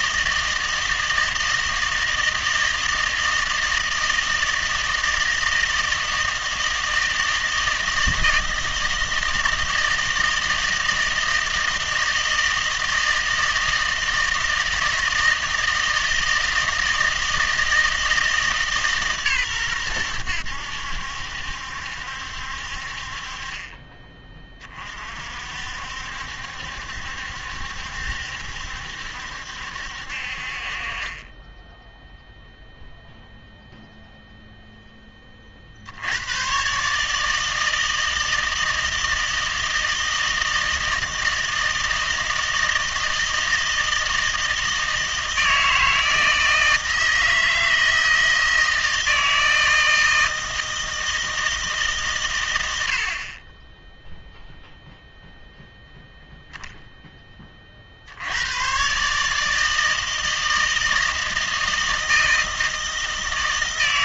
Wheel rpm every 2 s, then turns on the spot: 160, 160, 160, 160, 160, 160, 160, 160, 160, 150, 90, 60, 30, 70, 70, 40, 0, 0, 130, 160, 160, 160, 160, 160, 160, 160, 90, 0, 0, 120, 160, 160.
none